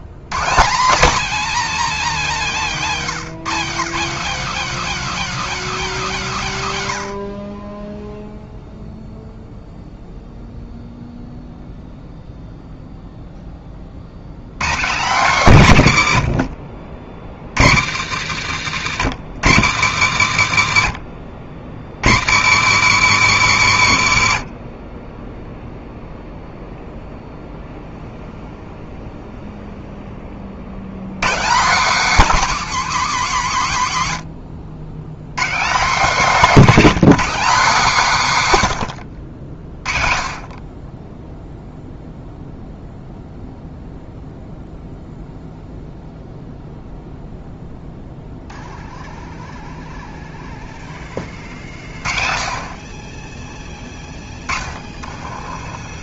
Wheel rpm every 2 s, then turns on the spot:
160, 220, 250, 150, 0, 0, 0, 160, 60, 120, 90, 120, 40, 0, 0, 70, 240, 100, 240, 140, 20, 0, 0, 0, 0, 0, 40, 30.
54-56